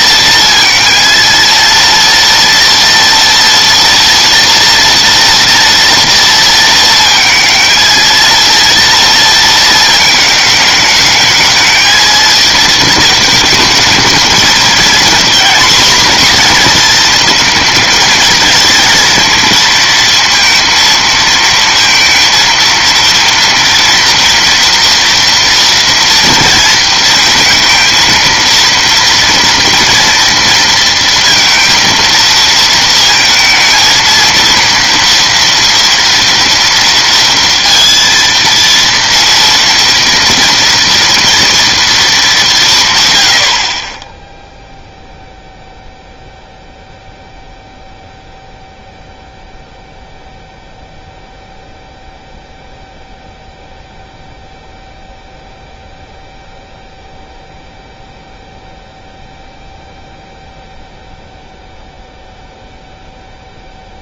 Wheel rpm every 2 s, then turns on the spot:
230, 230, 230, 230, 230, 220, 220, 220, 240, 230, 230, 230, 230, 230, 230, 230, 230, 230, 230, 230, 230, 200, 10, 0, 0, 0, 0, 0, 0, 0, 0, 0.
none